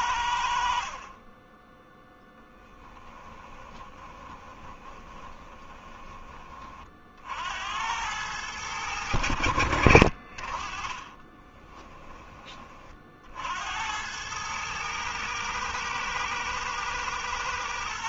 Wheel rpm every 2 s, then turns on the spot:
40, 10, 20, 50, 100, 40, 40, 110, 110.
2-6 10-12